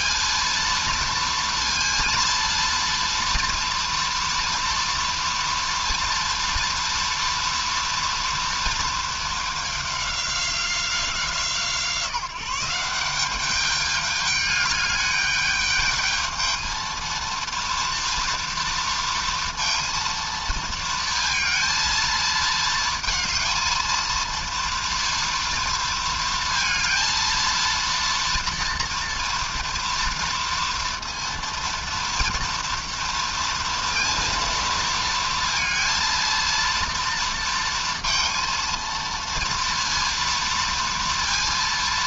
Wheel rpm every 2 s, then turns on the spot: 230, 230, 230, 230, 230, 190, 180, 210, 220, 230, 230, 220, 230, 230, 230, 230, 230, 230, 230, 230, 230.
none